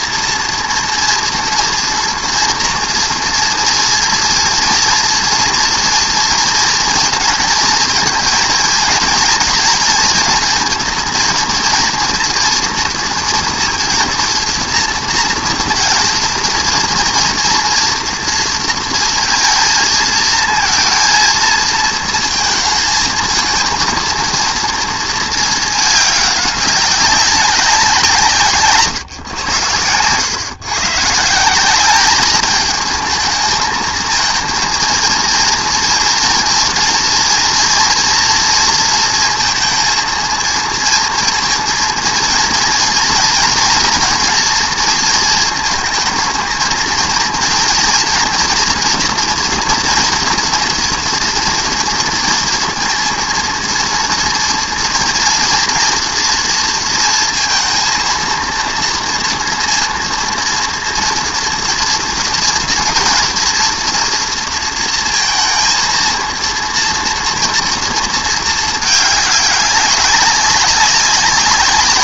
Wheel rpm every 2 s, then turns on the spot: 240, 230, 230, 230, 230, 230, 230, 230, 230, 230, 230, 220, 230, 200, 150, 140, 220, 230, 240, 230, 230, 230, 230, 220, 240, 230, 230, 230, 230, 230, 230, 230, 230, 230, 220, 200.
none